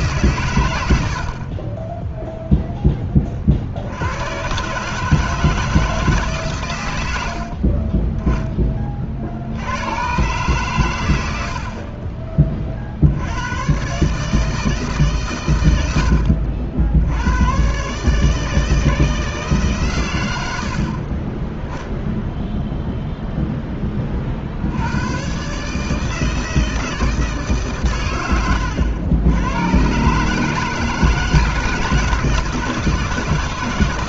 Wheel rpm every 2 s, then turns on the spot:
90, 10, 140, 90, 30, 110, 60, 150, 70, 160, 40, 0, 90, 160, 110, 150, 160.
none